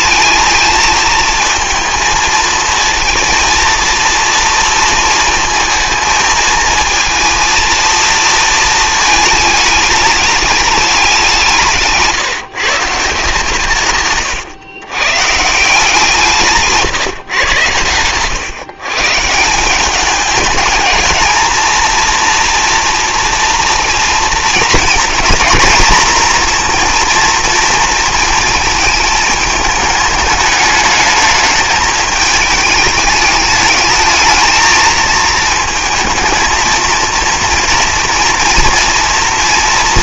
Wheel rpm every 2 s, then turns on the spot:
220, 230, 230, 230, 230, 210, 150, 120, 160, 130, 210, 240, 230, 240, 220, 210, 210, 220, 230, 230.
none